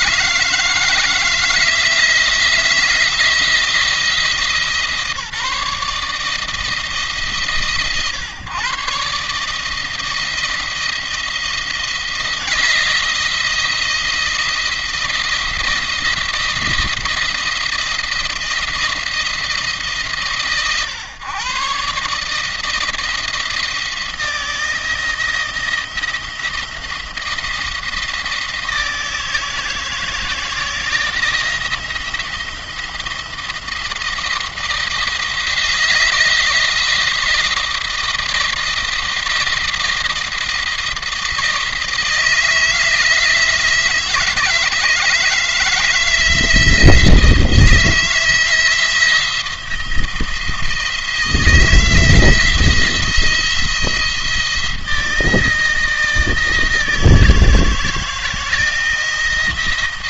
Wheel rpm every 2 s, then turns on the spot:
160, 170, 150, 150, 130, 170, 170, 170, 170, 170, 130, 160, 160, 170, 160, 160, 170, 160, 160, 170, 170, 160, 160, 160, 170, 170, 170, 160, 160, 170.
none